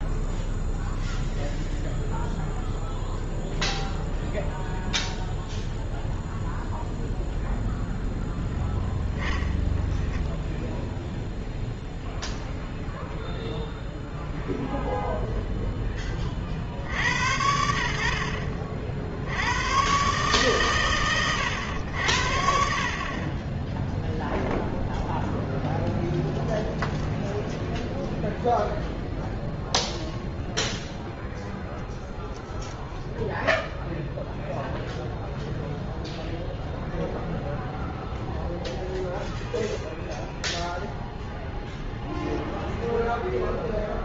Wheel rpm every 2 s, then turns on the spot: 0, 0, 0, 0, 0, 10, 10, 0, 60, 50, 120, 50, 0, 10, 0, 0, 0, 0, 0, 0, 0, 0.
26-28